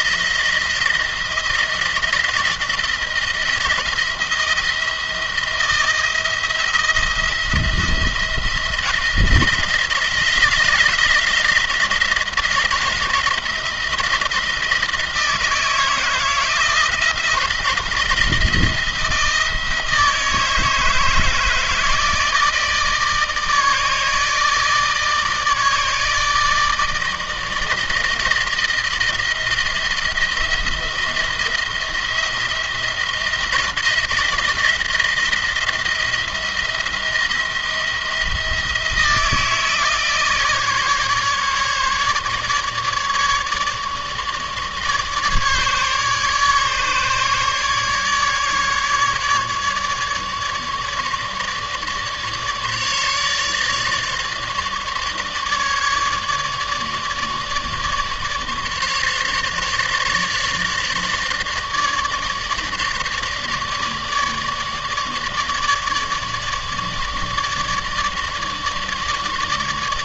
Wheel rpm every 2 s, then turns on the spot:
160, 160, 160, 170, 160, 160, 160, 160, 160, 160, 160, 160, 160, 160, 170, 170, 170, 170, 170, 170, 160, 150, 150, 150, 150, 150, 150, 150, 150, 150, 150, 150, 150, 150, 150.
none